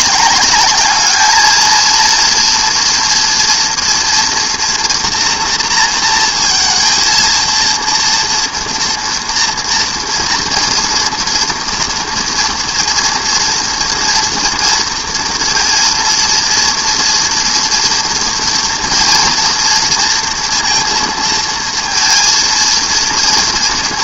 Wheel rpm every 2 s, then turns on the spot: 210, 230, 230, 230, 240, 230, 230, 230, 230, 230, 230, 230.
none